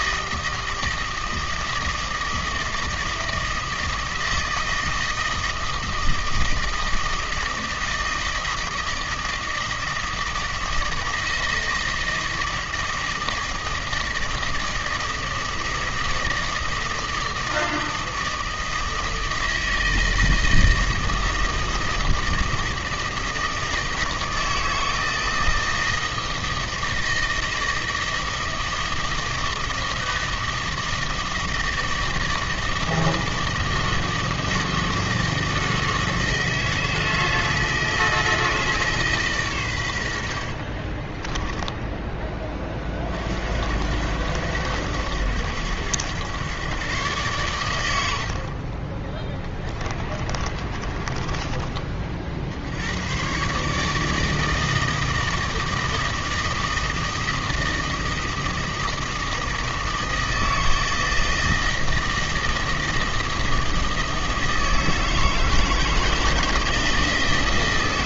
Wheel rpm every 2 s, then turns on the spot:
160, 160, 160, 160, 160, 160, 160, 160, 160, 160, 160, 160, 160, 160, 160, 160, 160, 160, 160, 160, 40, 30, 100, 130, 30, 20, 80, 160, 160, 160, 160, 160, 160, 160.
40-42 48-52